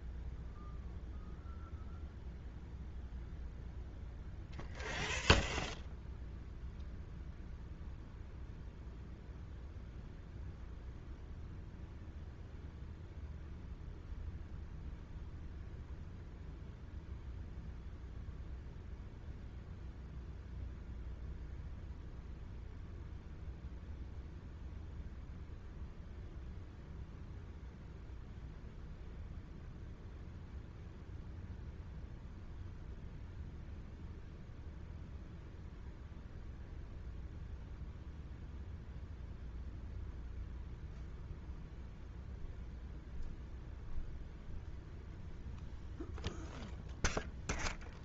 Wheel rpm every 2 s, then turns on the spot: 0, 0, 0, 0, 0, 0, 0, 0, 0, 0, 0, 0, 0, 0, 0, 0, 0, 0, 0, 0, 0, 0, 0, 0.
none